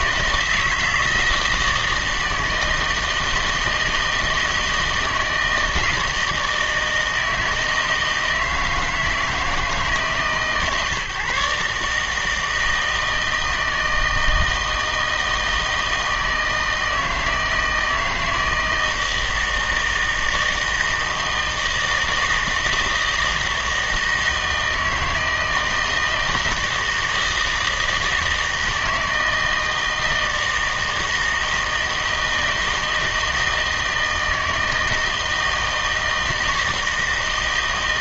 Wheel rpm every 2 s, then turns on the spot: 160, 160, 160, 160, 160, 150, 160, 160, 160, 160, 160, 160, 160, 160, 160, 160, 160, 160, 160.
none